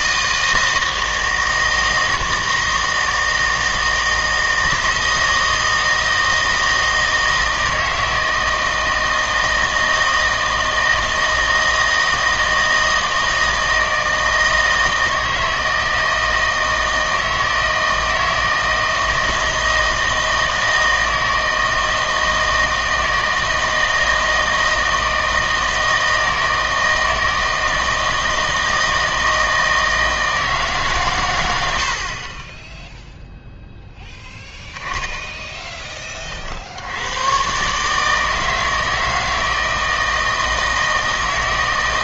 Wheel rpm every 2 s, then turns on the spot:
160, 160, 160, 160, 160, 160, 160, 160, 160, 160, 160, 160, 160, 160, 160, 150, 10, 10, 60, 160, 160.
none